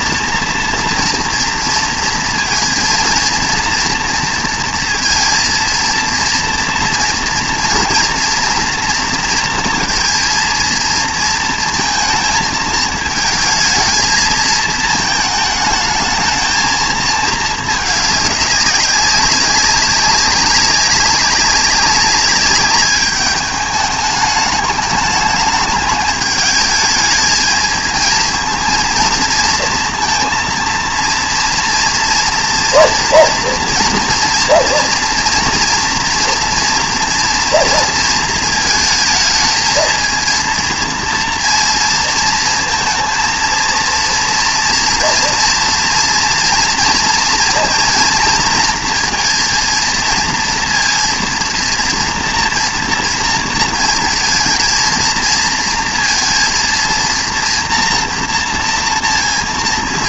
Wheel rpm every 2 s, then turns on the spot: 230, 230, 230, 230, 240, 230, 220, 220, 220, 200, 200, 200, 210, 210, 230, 230, 240, 230, 230, 220, 230, 230, 230, 230, 230, 230, 230, 230, 230, 230.
none